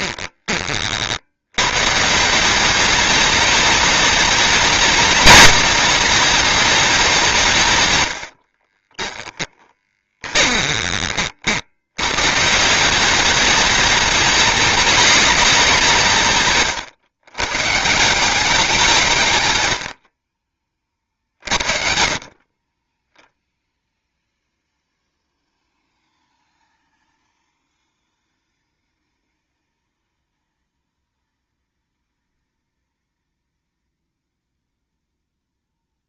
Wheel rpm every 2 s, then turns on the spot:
30, 190, 210, 210, 40, 20, 160, 200, 130, 190, 40, 20, 0, 0, 0, 0, 0, 0.
8-12 16-18